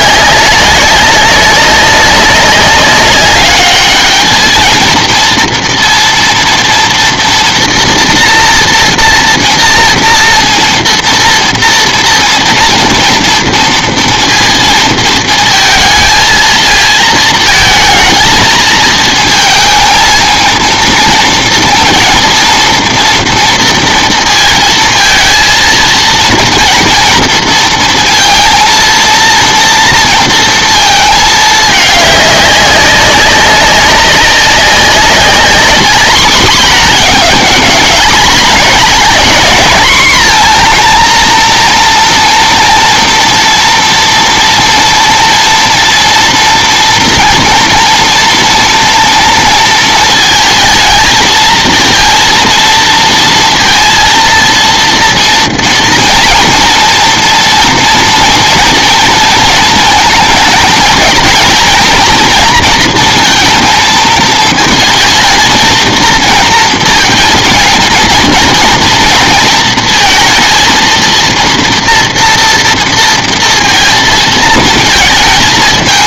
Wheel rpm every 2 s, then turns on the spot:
200, 200, 220, 230, 230, 230, 230, 230, 220, 220, 220, 230, 230, 230, 230, 230, 200, 200, 220, 210, 240, 230, 230, 230, 230, 220, 230, 230, 230, 230, 220, 230, 220, 230, 230, 230, 230, 230.
none